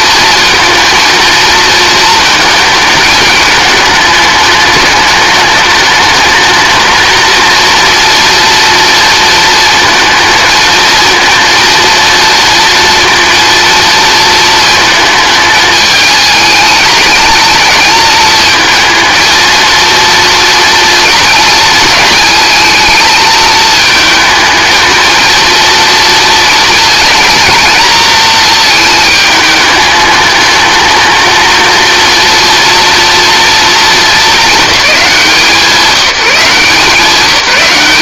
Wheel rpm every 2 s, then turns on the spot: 230, 220, 210, 220, 230, 220, 230, 220, 210, 220, 230, 220, 220, 230, 220, 220, 230, 210, 180.
none